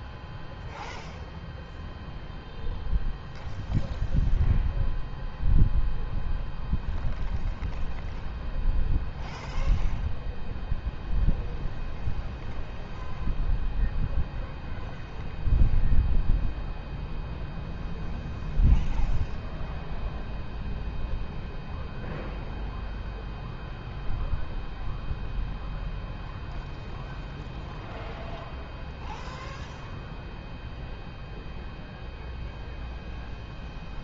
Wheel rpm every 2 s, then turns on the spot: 0, 0, 0, 0, 0, 0, 0, 0, 0, 0, 0, 0, 0, 0, 0, 0, 0.
none